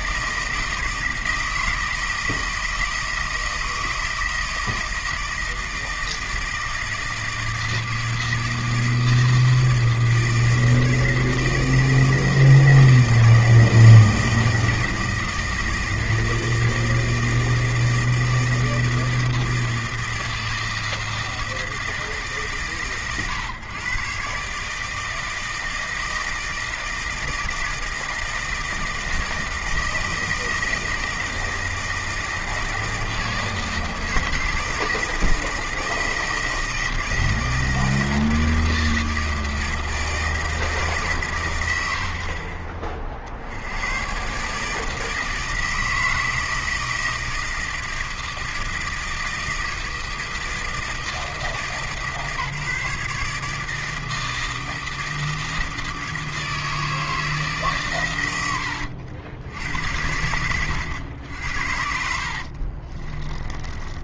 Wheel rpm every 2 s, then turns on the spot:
160, 160, 160, 160, 160, 160, 160, 160, 160, 160, 160, 140, 150, 160, 160, 160, 160, 160, 160, 160, 150, 30, 150, 160, 160, 160, 150, 160, 160, 100, 100, 40.
62-64